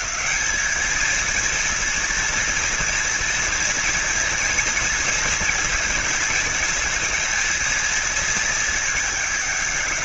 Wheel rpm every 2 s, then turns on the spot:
220, 230, 230, 220, 220.
none